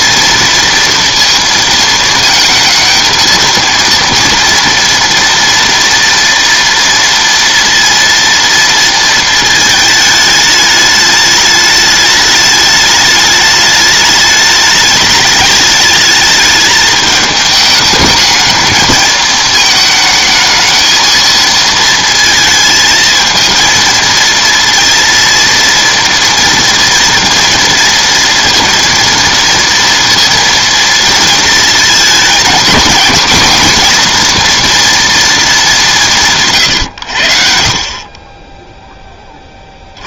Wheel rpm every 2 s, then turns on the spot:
230, 230, 230, 230, 220, 210, 210, 210, 210, 220, 220, 220, 230, 230, 230, 230, 230, 230, 70, 20.
none